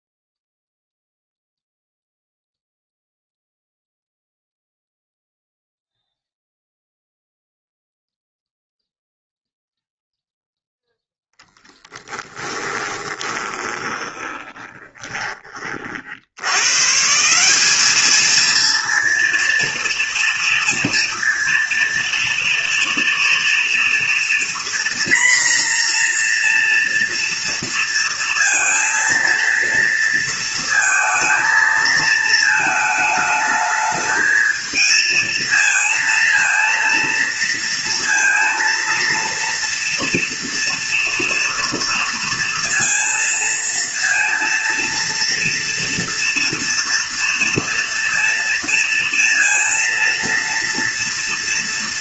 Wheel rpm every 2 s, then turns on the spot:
0, 0, 0, 0, 0, 0, 20, 20, 140, 230, 230, 230, 240, 230, 230, 230, 220, 220, 230, 230, 230, 230, 230, 230, 230, 230.
12-16